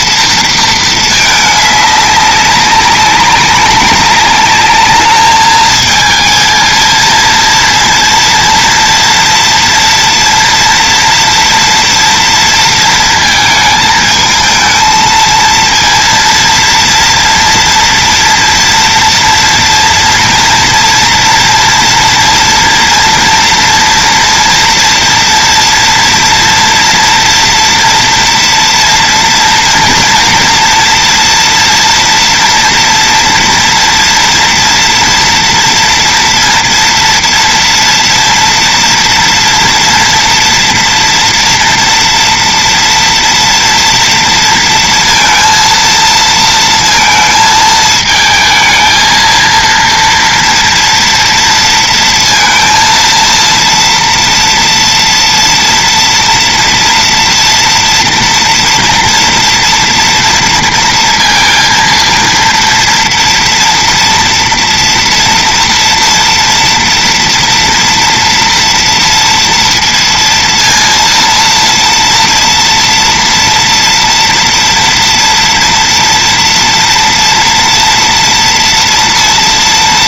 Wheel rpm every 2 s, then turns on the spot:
230, 200, 200, 220, 230, 240, 230, 220, 230, 230, 230, 240, 230, 230, 240, 230, 240, 230, 230, 240, 230, 240, 230, 230, 220, 230, 230, 230, 240, 230, 230, 230, 240, 230, 230, 230, 230, 230, 230, 230.
none